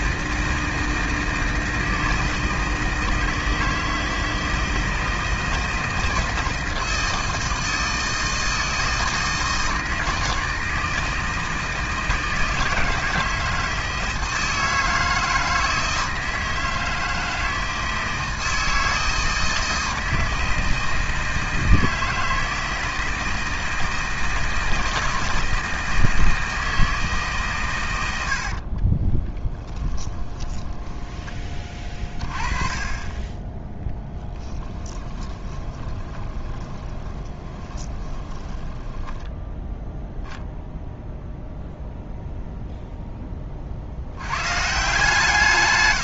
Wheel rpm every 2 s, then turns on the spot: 160, 160, 160, 160, 160, 160, 160, 160, 160, 160, 160, 160, 160, 160, 40, 10, 20, 20, 30, 10, 0, 0, 150.
28-32 34-38